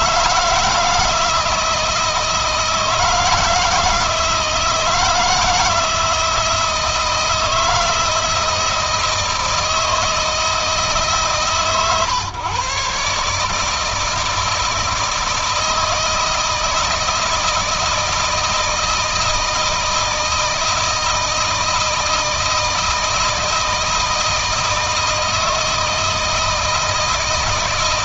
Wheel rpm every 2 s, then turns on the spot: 160, 160, 160, 160, 160, 150, 140, 160, 160, 170, 160, 160, 160, 160.
none